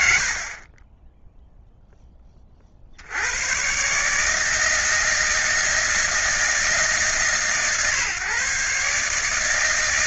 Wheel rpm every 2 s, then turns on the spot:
0, 140, 160, 150, 150.
none